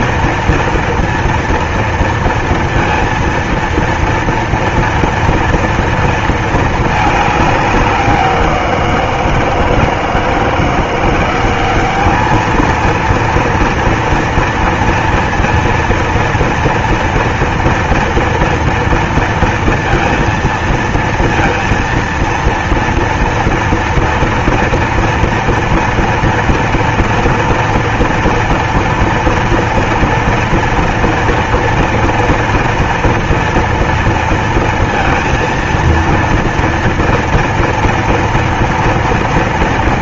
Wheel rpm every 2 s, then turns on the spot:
240, 230, 230, 220, 180, 170, 220, 230, 230, 230, 230, 230, 230, 230, 230, 230, 230, 230, 230, 230.
none